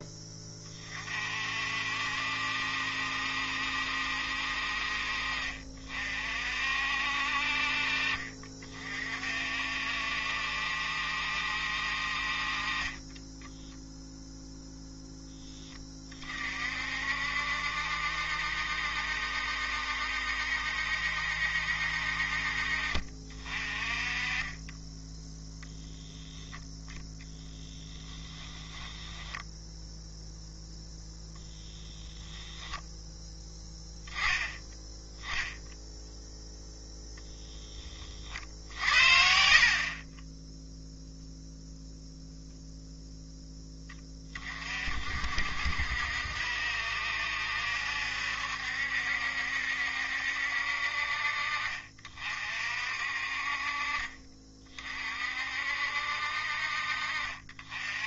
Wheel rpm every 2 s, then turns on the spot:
30, 70, 50, 60, 40, 70, 30, 0, 50, 70, 70, 50, 10, 10, 20, 0, 0, 0, 0, 60, 0, 0, 50, 70, 70, 60, 50, 40, 50.
28-30 56-58